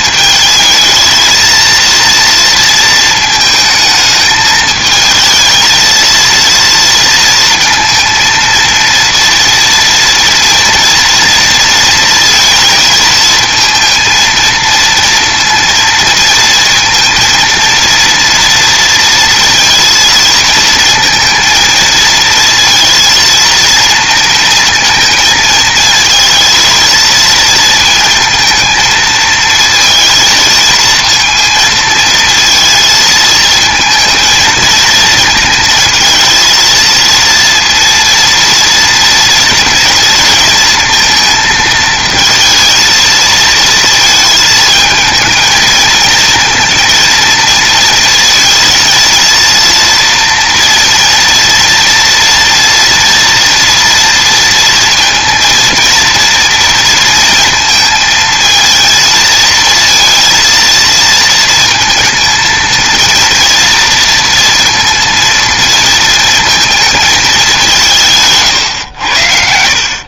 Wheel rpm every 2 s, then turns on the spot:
220, 230, 220, 230, 230, 230, 220, 230, 230, 230, 230, 230, 230, 230, 220, 230, 220, 230, 230, 230, 230, 220, 220, 230, 230, 230, 230, 230, 230, 230, 230, 230, 230, 220, 110.
none